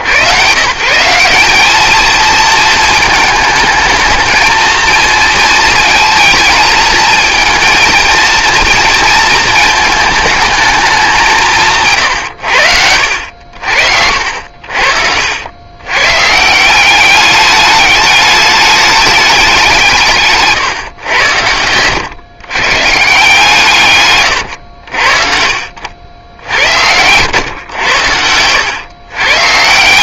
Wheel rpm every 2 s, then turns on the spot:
220, 230, 220, 230, 200, 80, 70, 190, 210, 130, 130, 90, 90, 110, 220.
12-14